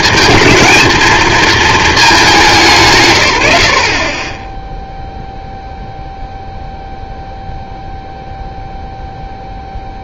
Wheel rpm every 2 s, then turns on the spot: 220, 170, 10, 0, 0.
none